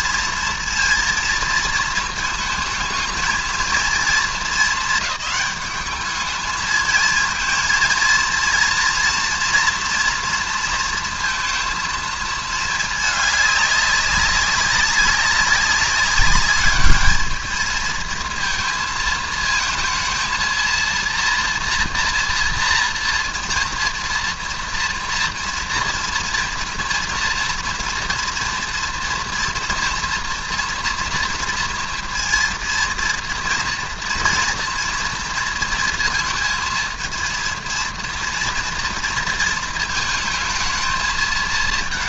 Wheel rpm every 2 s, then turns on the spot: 230, 220, 210, 220, 230, 230, 220, 200, 210, 230, 230, 240, 230, 230, 230, 230, 230, 230, 230, 230, 220.
none